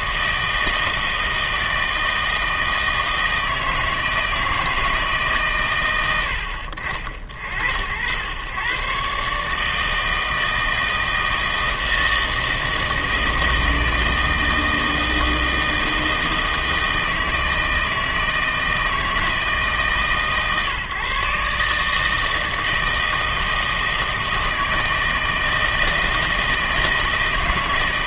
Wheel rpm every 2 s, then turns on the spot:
160, 160, 160, 60, 140, 160, 160, 160, 160, 160, 140, 160, 160, 160.
none